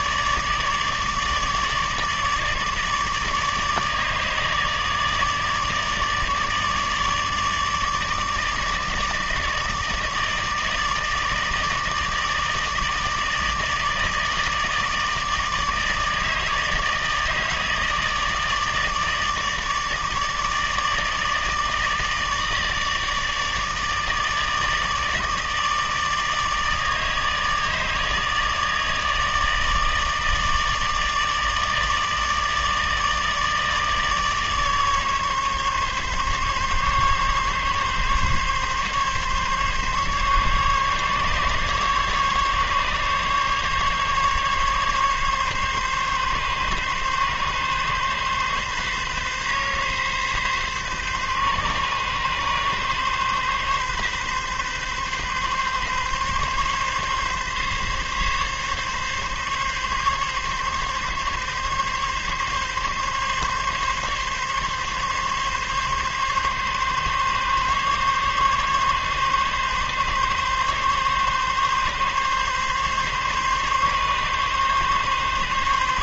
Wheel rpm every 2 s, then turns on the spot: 150, 150, 150, 150, 150, 150, 160, 160, 160, 160, 160, 160, 160, 150, 160, 150, 160, 150, 140, 140, 140, 140, 140, 140, 140, 140, 140, 140, 140, 140, 140, 140, 140, 140, 140, 140, 140, 140.
none